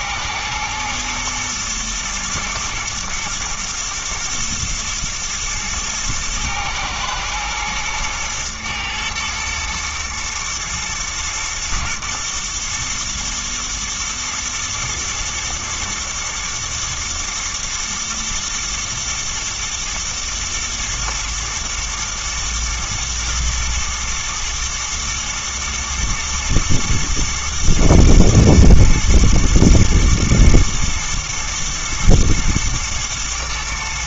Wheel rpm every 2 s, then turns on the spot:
110, 120, 120, 110, 120, 110, 110, 120, 120, 110, 110, 110, 110, 110, 110, 110, 110.
none